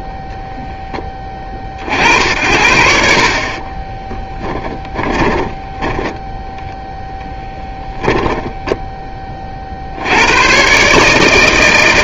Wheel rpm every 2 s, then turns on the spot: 10, 60, 20, 10, 10, 120.
4-6 8-10